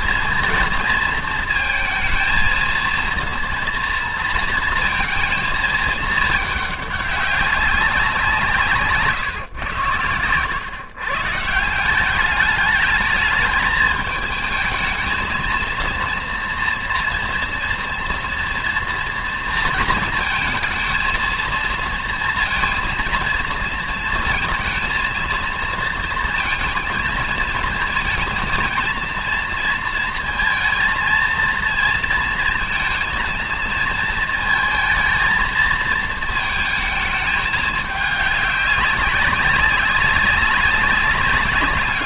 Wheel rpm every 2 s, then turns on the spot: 230, 230, 230, 210, 160, 120, 210, 220, 230, 230, 220, 230, 230, 230, 230, 230, 230, 220, 220, 200, 190.
none